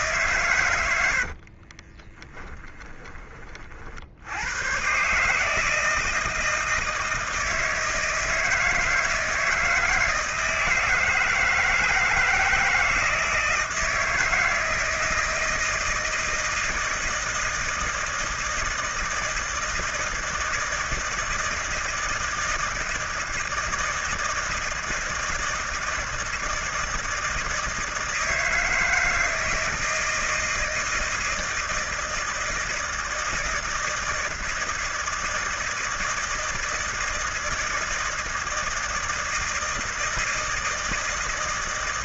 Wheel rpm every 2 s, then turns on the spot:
100, 20, 120, 160, 160, 160, 160, 160, 160, 160, 160, 160, 160, 160, 160, 160, 160, 160, 160, 160, 160.
0-4